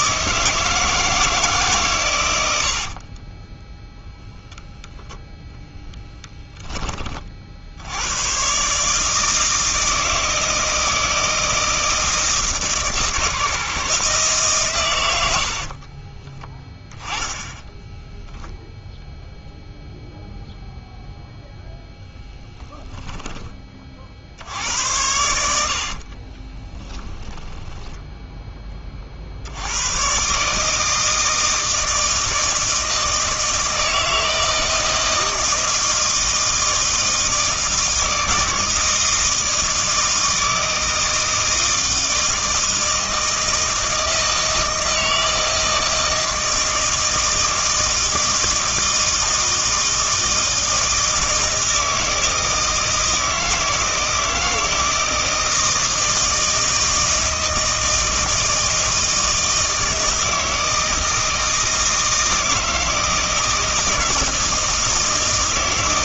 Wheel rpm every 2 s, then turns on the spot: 160, 80, 0, 10, 140, 160, 160, 130, 10, 0, 0, 30, 80, 20, 20, 160, 160, 160, 160, 160, 160, 160, 160, 160, 160, 160, 160, 160, 160, 160, 160, 160, 160.
22-24 26-28